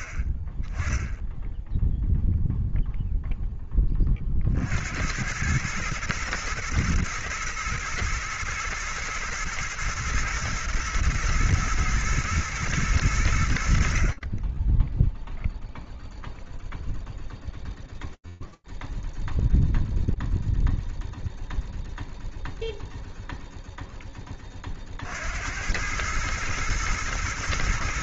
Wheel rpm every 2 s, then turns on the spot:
20, 0, 70, 110, 110, 120, 110, 10, 0, 0, 0, 0, 80, 110.
none